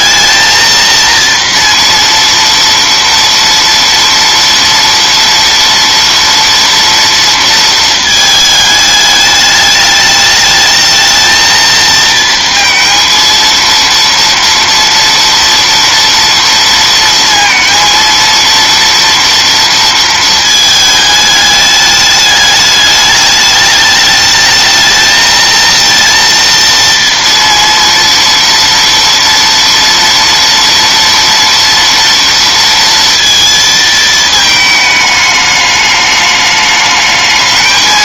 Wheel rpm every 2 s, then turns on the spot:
230, 230, 230, 230, 220, 220, 230, 230, 230, 230, 220, 210, 220, 230, 230, 230, 230, 220, 210.
none